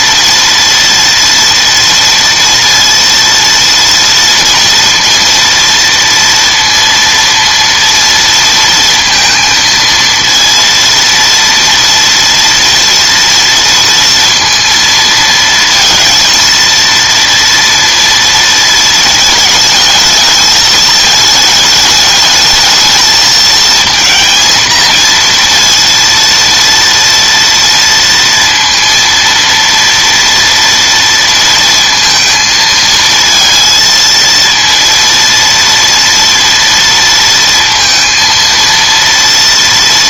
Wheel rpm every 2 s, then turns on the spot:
230, 230, 230, 230, 230, 230, 230, 230, 230, 220, 220, 220, 230, 230, 230, 230, 230, 230, 230, 230.
none